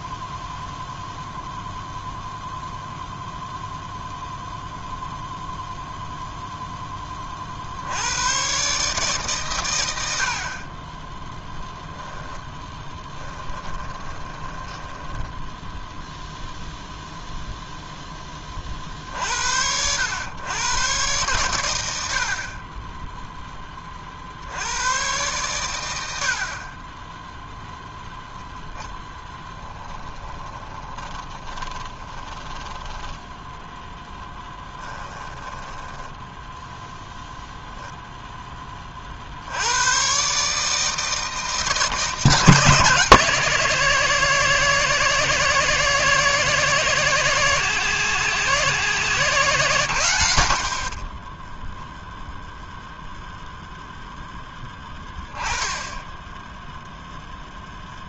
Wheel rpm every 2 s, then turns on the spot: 0, 0, 0, 60, 120, 10, 10, 10, 0, 70, 110, 0, 110, 0, 10, 20, 10, 10, 0, 30, 150, 160, 170, 170, 170, 50, 0, 10, 0.
12-16 30-36